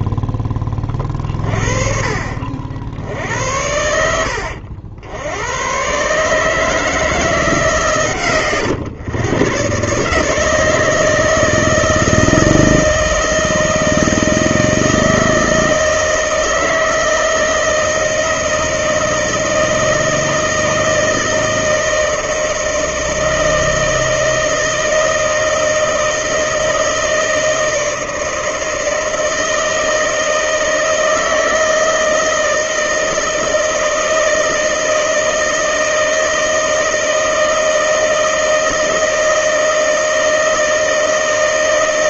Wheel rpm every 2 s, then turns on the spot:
20, 60, 70, 160, 120, 150, 160, 160, 160, 160, 160, 160, 160, 160, 160, 160, 160, 160, 160, 160, 160.
none